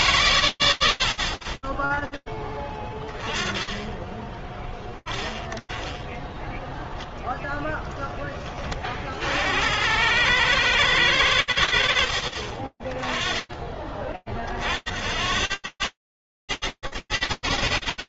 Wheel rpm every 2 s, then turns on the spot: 30, 10, 10, 10, 90, 70, 10, 80, 100.
none